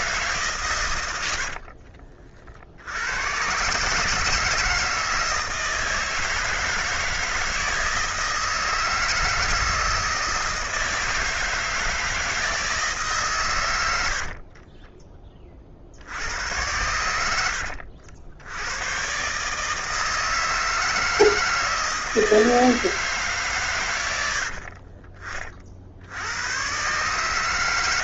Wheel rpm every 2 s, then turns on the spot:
130, 60, 160, 160, 160, 160, 160, 30, 90, 100, 160, 160, 40, 110.
14-16 24-26